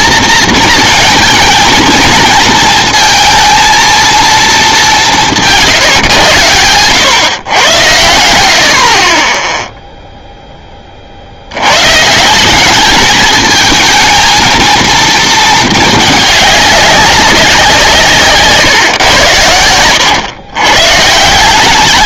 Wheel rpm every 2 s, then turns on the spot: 220, 230, 200, 100, 60, 30, 200, 230, 200, 130, 130.
none